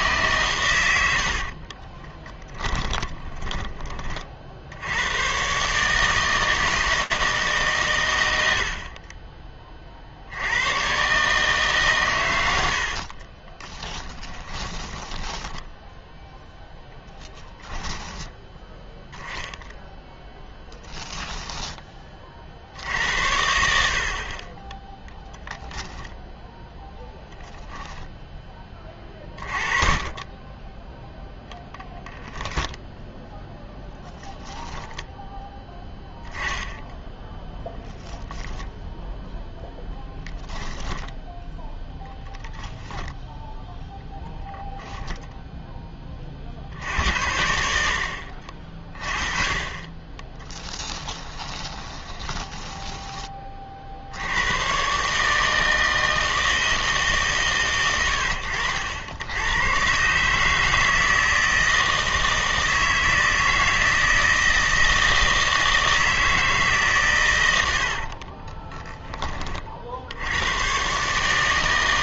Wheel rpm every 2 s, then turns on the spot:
110, 10, 70, 160, 60, 110, 80, 10, 10, 10, 10, 60, 20, 10, 30, 10, 0, 0, 10, 0, 10, 0, 0, 60, 50, 10, 10, 120, 160, 80, 160, 160, 160, 150, 20, 120.
2-4 12-16 20-22 40-42 50-54 68-70